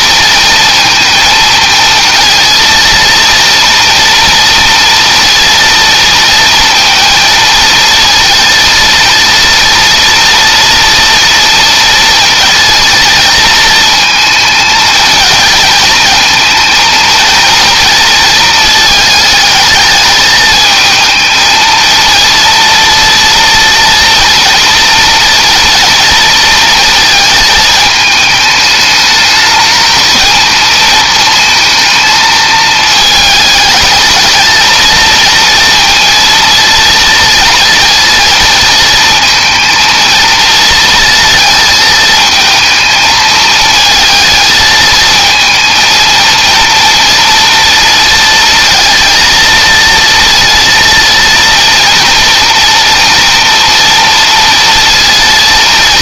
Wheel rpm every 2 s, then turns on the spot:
230, 230, 230, 230, 230, 230, 230, 220, 230, 220, 220, 230, 230, 220, 220, 230, 220, 230, 230, 230, 230, 220, 220, 230, 230, 230, 230, 230.
none